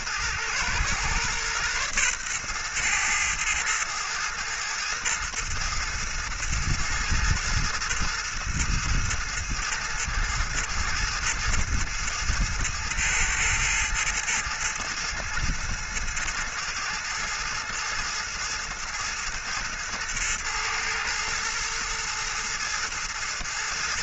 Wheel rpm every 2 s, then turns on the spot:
120, 120, 110, 110, 110, 110, 110, 110, 110, 110, 120, 110.
none